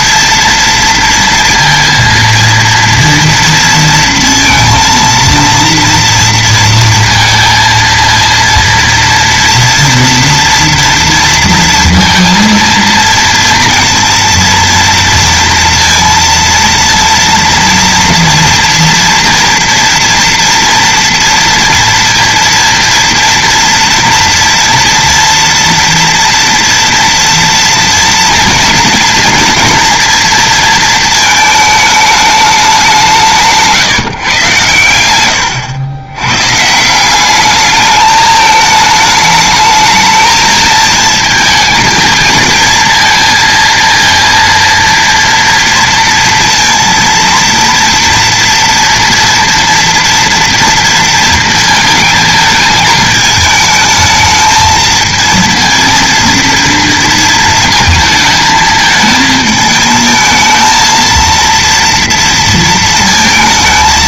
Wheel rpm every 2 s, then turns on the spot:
230, 230, 230, 230, 230, 240, 230, 230, 230, 230, 230, 230, 230, 240, 230, 230, 200, 110, 160, 210, 220, 220, 230, 230, 230, 230, 220, 220, 230, 220, 230, 230.
none